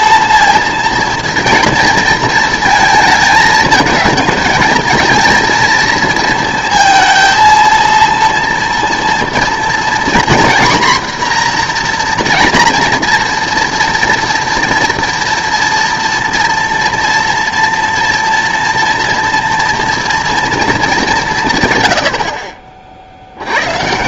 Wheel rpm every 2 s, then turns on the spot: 230, 220, 220, 230, 230, 250, 240, 230, 230, 240, 230, 50.
none